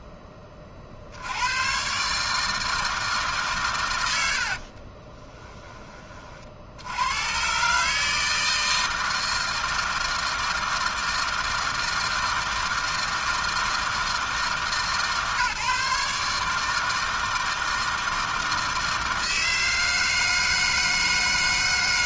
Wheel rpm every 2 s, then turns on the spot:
60, 160, 30, 120, 160, 160, 160, 150, 160, 160, 160.
4-6